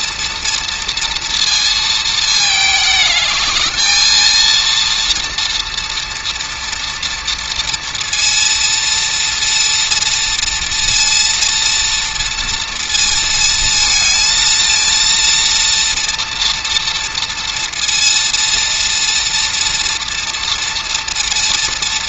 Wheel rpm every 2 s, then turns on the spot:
230, 210, 230, 230, 230, 230, 230, 230, 230, 230, 230.
none